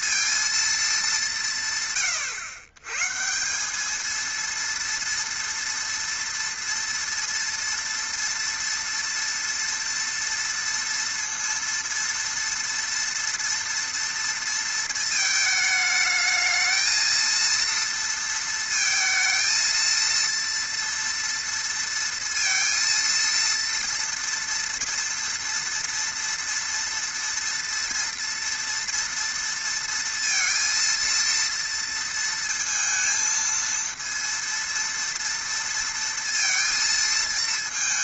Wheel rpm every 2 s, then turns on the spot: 130, 230, 230, 230, 230, 230, 220, 220, 230, 230, 230, 230, 230, 240, 230, 230, 230, 230, 220.
none